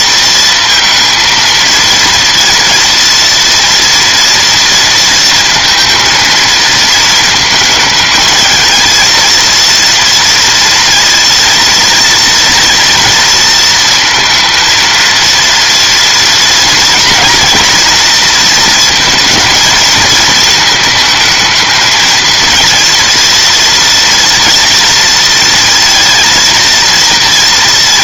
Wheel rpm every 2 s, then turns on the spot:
230, 230, 230, 230, 220, 230, 240, 230, 230, 230, 220, 230, 230, 230.
none